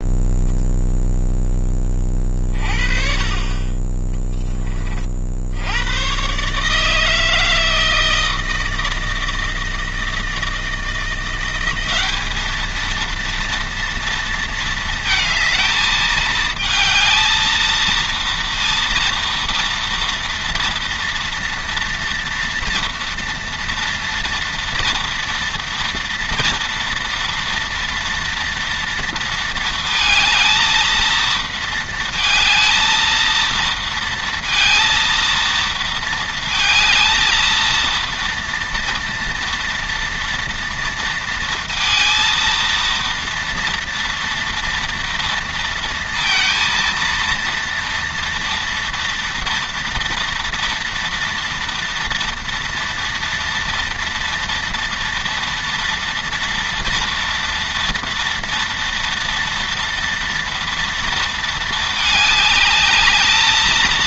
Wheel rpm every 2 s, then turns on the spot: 0, 30, 50, 160, 160, 170, 230, 230, 220, 230, 230, 230, 230, 230, 230, 230, 230, 230, 230, 230, 230, 230, 230, 230, 230, 230, 230, 240, 240, 230, 230, 210.
none